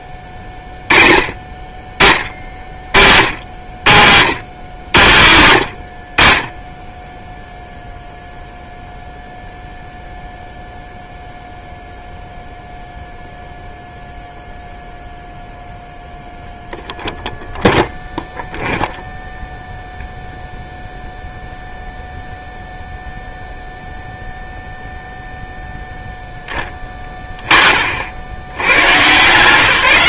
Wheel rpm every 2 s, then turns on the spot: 20, 80, 120, 20, 0, 0, 0, 0, 0, 0, 0, 0, 0, 10, 110.
none